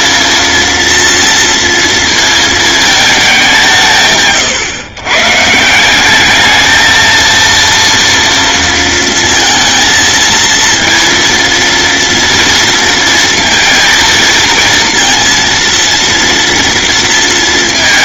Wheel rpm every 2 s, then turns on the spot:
230, 220, 130, 220, 230, 230, 230, 230, 230.
none